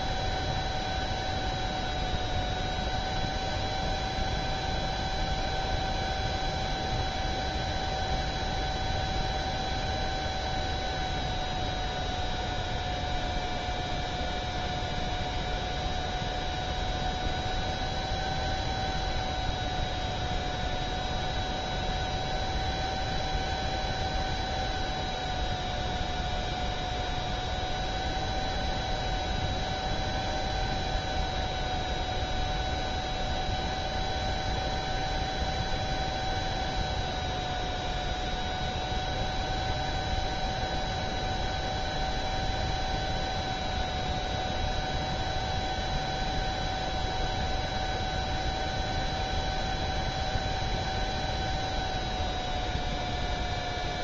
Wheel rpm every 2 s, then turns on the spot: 0, 0, 0, 0, 0, 0, 0, 0, 0, 0, 0, 0, 0, 0, 0, 0, 0, 0, 0, 0, 0, 0, 0, 0, 0, 0, 0.
none